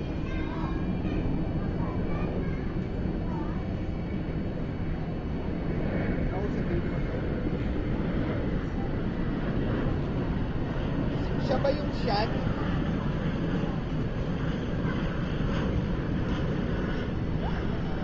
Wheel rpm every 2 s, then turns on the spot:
0, 0, 0, 0, 0, 0, 0, 0, 0.
none